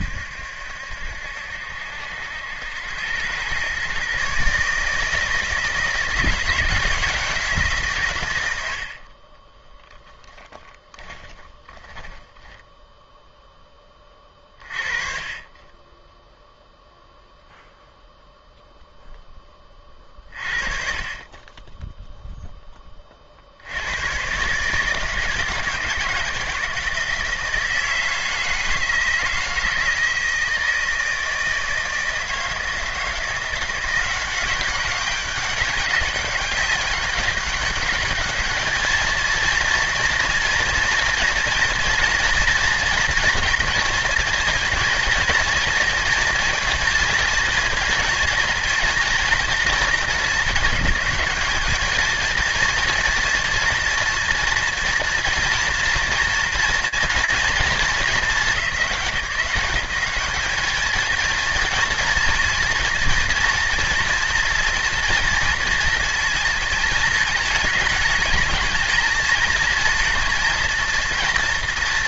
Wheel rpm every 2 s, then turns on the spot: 70, 100, 150, 170, 60, 20, 0, 30, 0, 0, 40, 20, 150, 160, 160, 160, 160, 190, 200, 220, 230, 230, 230, 230, 230, 210, 230, 240, 230, 180, 220, 230, 230, 220, 220, 230.
8-12